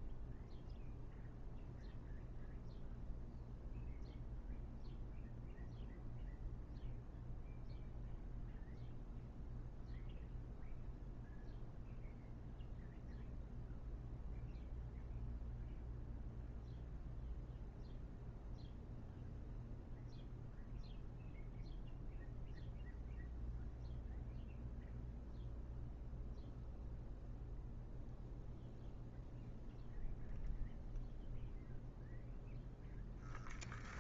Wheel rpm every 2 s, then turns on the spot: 0, 0, 0, 0, 0, 0, 0, 0, 0, 0, 0, 0, 0, 0, 0, 0, 0.
none